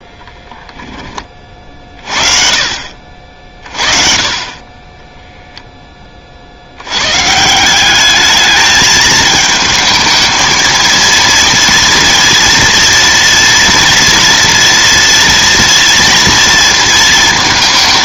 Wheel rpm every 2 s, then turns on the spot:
10, 50, 30, 60, 210, 230, 230, 230, 230.
none